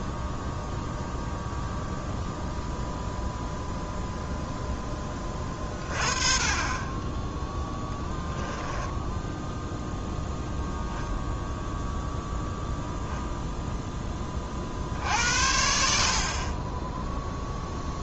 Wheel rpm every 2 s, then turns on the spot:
0, 0, 10, 20, 10, 0, 0, 60, 10.
none